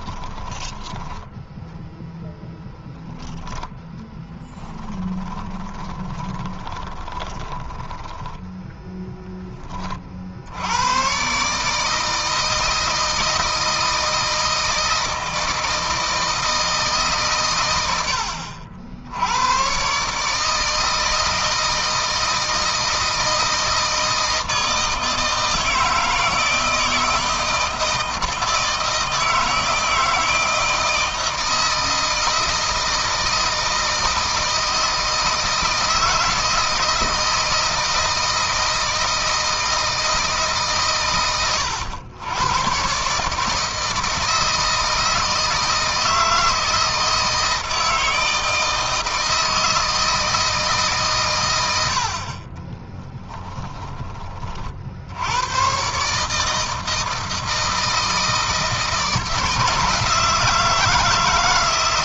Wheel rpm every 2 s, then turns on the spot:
20, 0, 10, 20, 10, 100, 160, 160, 150, 70, 160, 160, 160, 160, 160, 160, 160, 160, 160, 160, 140, 120, 160, 160, 160, 150, 20, 50, 160, 160, 160.
0-2 4-8 52-54